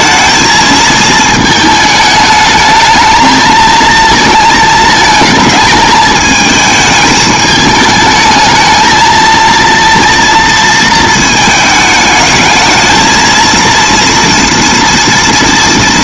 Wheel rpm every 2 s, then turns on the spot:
220, 220, 220, 220, 220, 230, 220, 230.
none